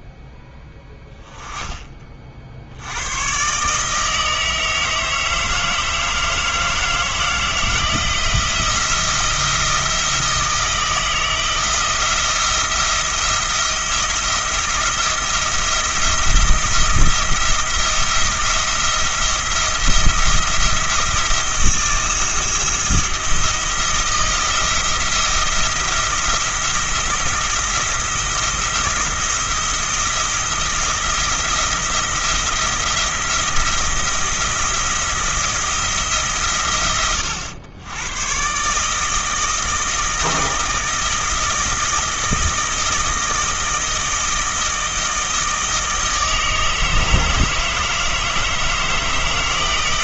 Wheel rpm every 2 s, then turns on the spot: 10, 80, 160, 160, 170, 170, 170, 170, 170, 170, 170, 170, 170, 170, 170, 170, 170, 170, 100, 150, 160, 160, 160, 160, 160.
none